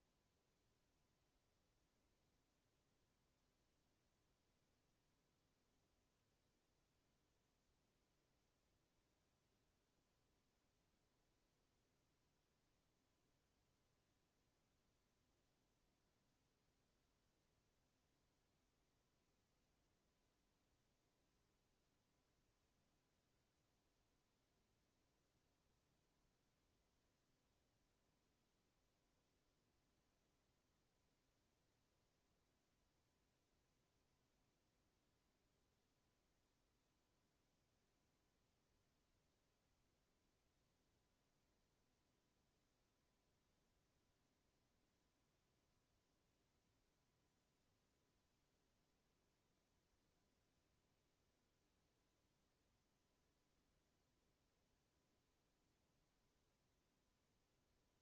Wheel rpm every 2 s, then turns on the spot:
0, 0, 0, 0, 0, 0, 0, 0, 0, 0, 0, 0, 0, 0, 0, 0, 0, 0, 0, 0, 0, 0, 0, 0, 0, 0, 0, 0, 0.
none